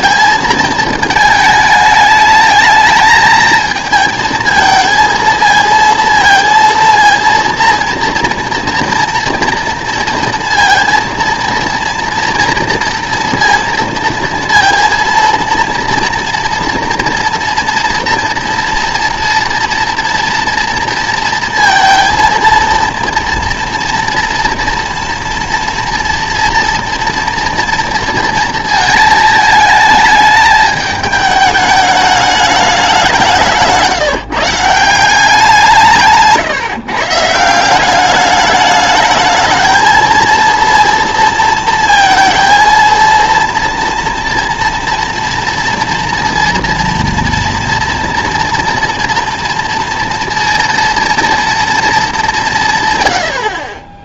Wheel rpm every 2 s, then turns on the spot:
220, 210, 220, 230, 230, 230, 230, 230, 240, 230, 230, 230, 230, 240, 230, 210, 200, 150, 150, 200, 230, 230, 230, 230, 240, 230, 170.
none